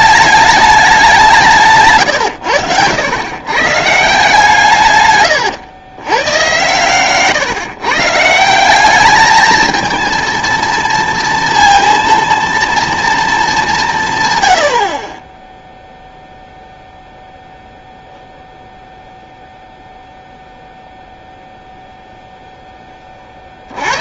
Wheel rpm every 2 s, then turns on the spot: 210, 90, 150, 110, 190, 230, 230, 90, 0, 0, 0, 10.
2-4